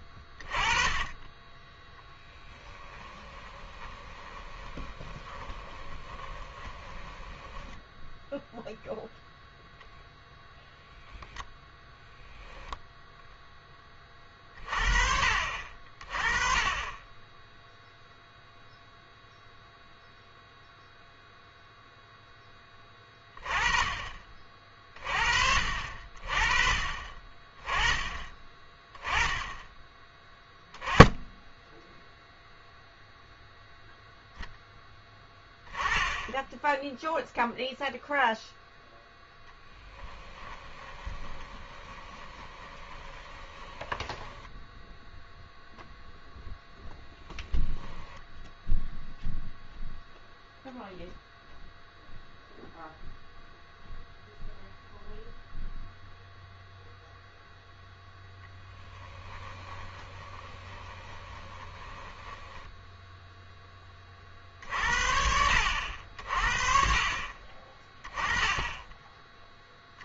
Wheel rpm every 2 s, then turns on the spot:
20, 20, 20, 20, 0, 10, 10, 30, 30, 0, 0, 10, 40, 30, 20, 10, 0, 10, 10, 0, 20, 20, 10, 10, 10, 0, 0, 0, 0, 10, 20, 10, 50, 50, 20.
2-8 40-50 60-64